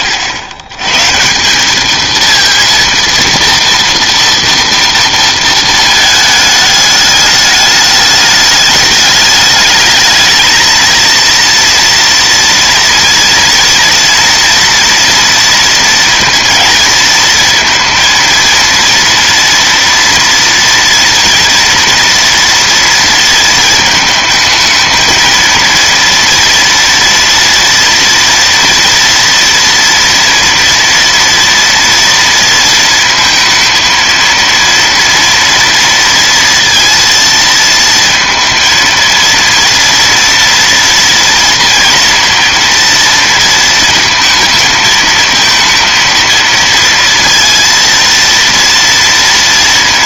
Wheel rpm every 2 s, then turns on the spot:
70, 220, 230, 220, 210, 210, 230, 230, 230, 230, 230, 230, 220, 230, 240, 230, 230, 230, 230, 230, 230, 230, 220, 230, 230.
none